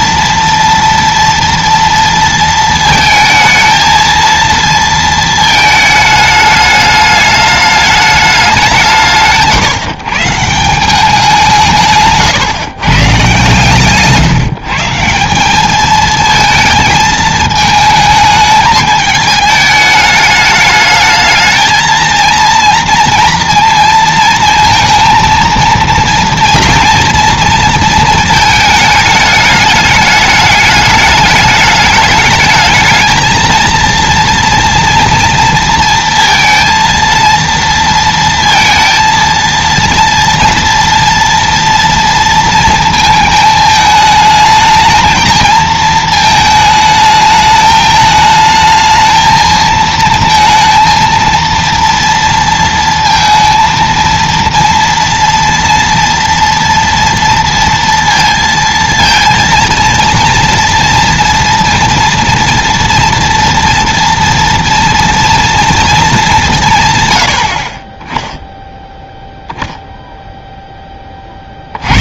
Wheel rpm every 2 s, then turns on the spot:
240, 230, 230, 210, 190, 180, 140, 160, 220, 220, 210, 230, 230, 240, 220, 210, 220, 230, 230, 230, 230, 230, 220, 220, 220, 230, 230, 230, 230, 230, 230, 240, 240, 140, 10, 20.
none